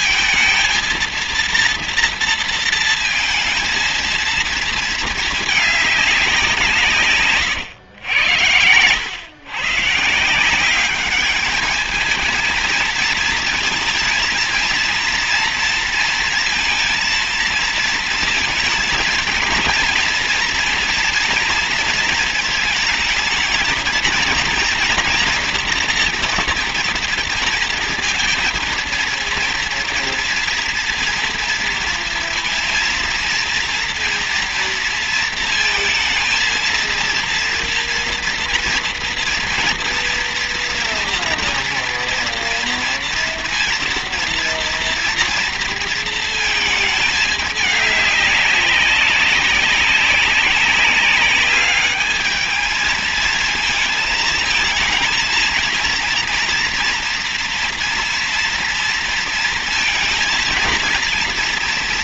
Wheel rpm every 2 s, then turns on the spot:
230, 230, 220, 170, 100, 180, 220, 230, 230, 220, 230, 220, 230, 230, 230, 230, 230, 230, 230, 230, 230, 230, 230, 220, 190, 190, 220, 220, 230, 230, 230.
none